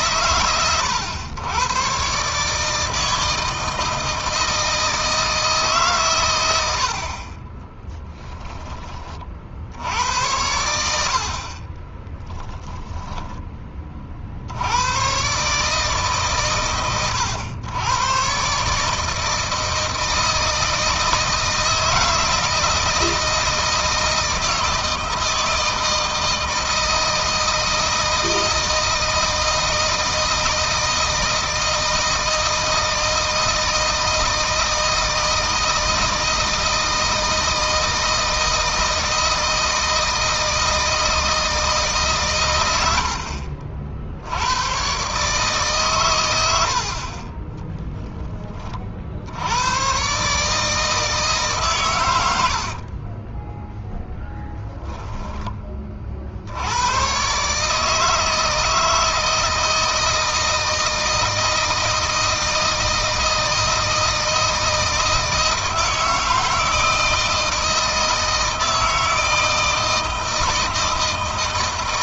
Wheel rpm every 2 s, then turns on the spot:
110, 150, 160, 70, 20, 80, 10, 90, 120, 140, 160, 160, 160, 160, 160, 160, 160, 160, 160, 160, 160, 110, 100, 80, 30, 150, 50, 0, 90, 160, 160, 160, 160, 160, 160, 160.
12-14 52-54